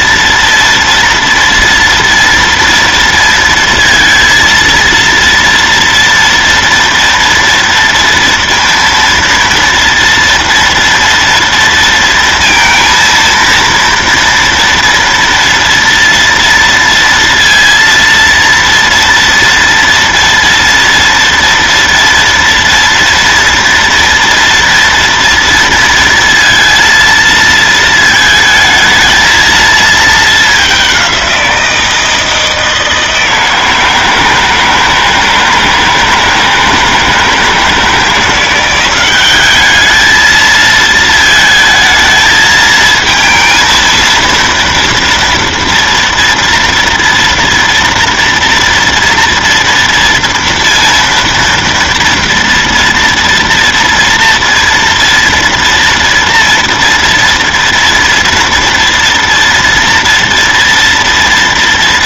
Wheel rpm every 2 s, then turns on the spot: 230, 230, 230, 230, 230, 230, 230, 230, 230, 230, 230, 230, 230, 230, 220, 210, 160, 160, 160, 170, 220, 220, 230, 230, 230, 230, 230, 230, 230, 230, 230.
none